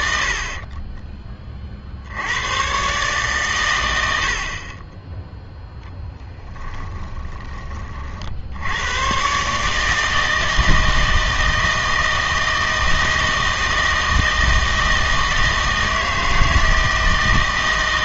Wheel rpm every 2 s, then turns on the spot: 30, 110, 40, 10, 80, 160, 160, 160, 160.
0-2 6-8